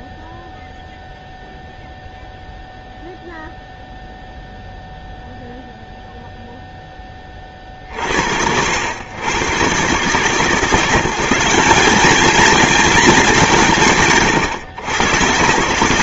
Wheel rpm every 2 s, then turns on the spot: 0, 0, 0, 0, 100, 170, 210, 110.
none